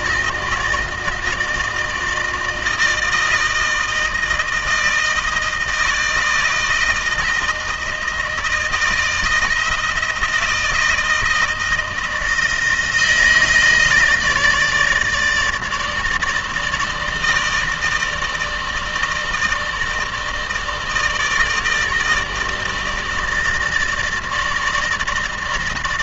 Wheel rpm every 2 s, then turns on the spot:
160, 160, 160, 160, 160, 160, 160, 150, 160, 160, 160, 160, 160.
none